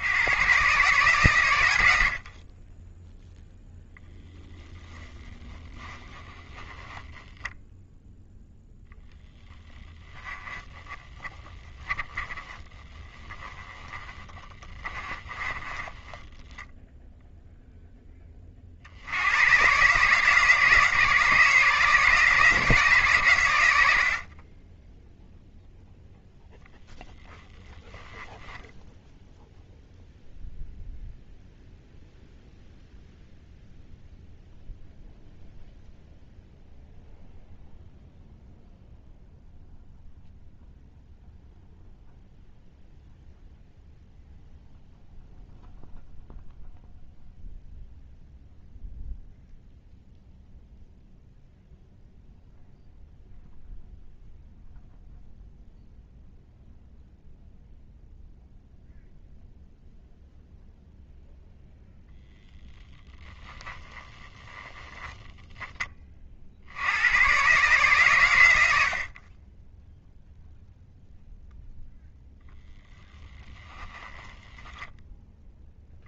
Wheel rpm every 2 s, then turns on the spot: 130, 20, 10, 20, 0, 20, 20, 30, 10, 40, 160, 150, 10, 0, 0, 0, 0, 0, 0, 0, 0, 0, 0, 0, 0, 0, 0, 0, 0, 0, 0, 0, 0, 70, 70, 0, 10, 10.
4-8 10-18